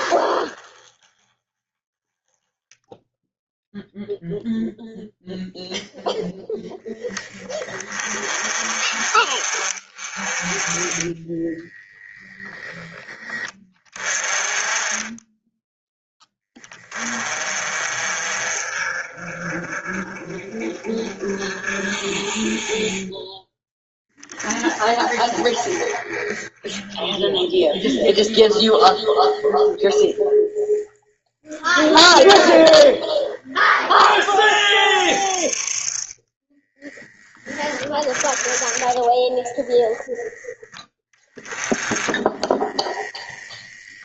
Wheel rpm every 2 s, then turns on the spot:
20, 10, 0, 10, 40, 30, 10, 20, 20, 40, 40, 30, 30, 10, 10, 10, 10, 30, 10, 20, 20, 20.
10-12 26-30 38-40